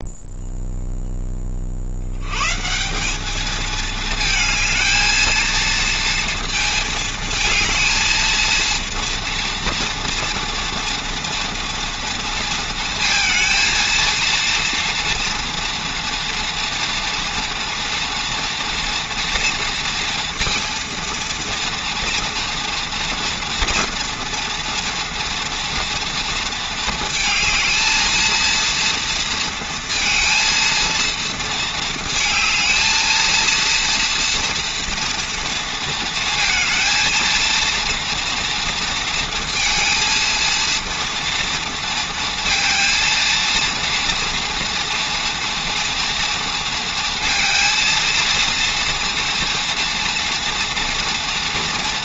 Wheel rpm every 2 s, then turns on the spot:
0, 110, 220, 230, 230, 230, 230, 230, 230, 230, 230, 230, 240, 230, 220, 230, 220, 230, 230, 230, 230, 230, 240, 230, 230, 240.
none